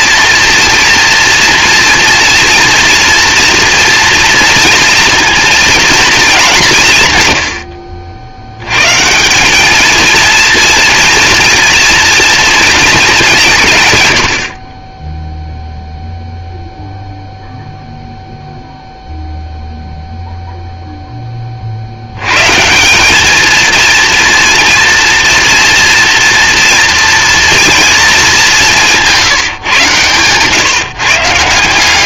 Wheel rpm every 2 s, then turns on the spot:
230, 240, 230, 160, 110, 230, 230, 30, 0, 0, 0, 160, 230, 230, 180, 150.
none